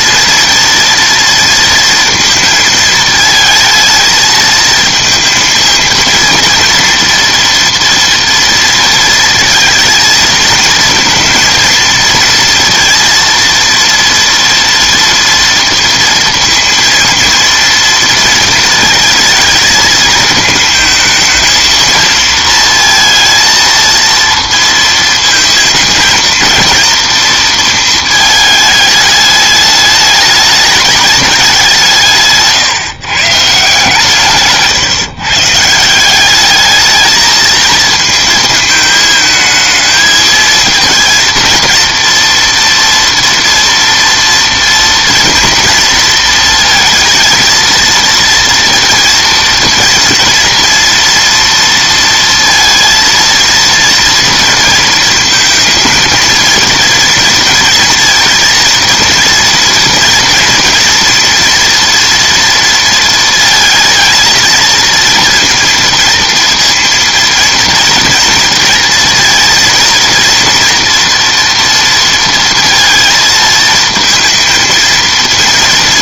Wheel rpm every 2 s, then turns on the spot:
230, 230, 220, 230, 230, 230, 230, 230, 230, 230, 220, 230, 230, 220, 210, 210, 140, 150, 210, 220, 230, 230, 230, 230, 230, 230, 230, 230, 230, 230, 230, 230, 220, 230, 230, 240, 230, 230.
none